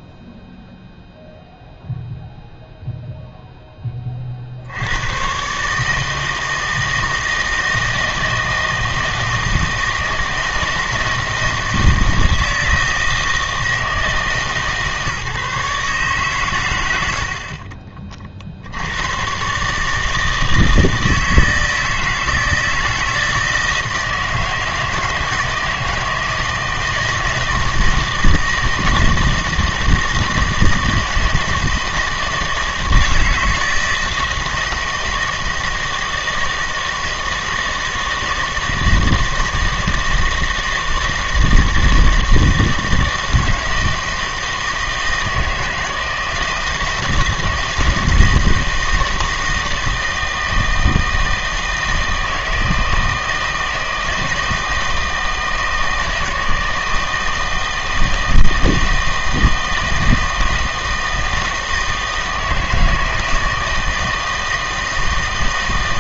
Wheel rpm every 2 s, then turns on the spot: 0, 0, 70, 160, 160, 160, 160, 150, 100, 70, 160, 160, 160, 160, 160, 160, 160, 160, 160, 160, 160, 160, 160, 160, 160, 160, 160, 160, 160, 160, 160, 160, 160.
none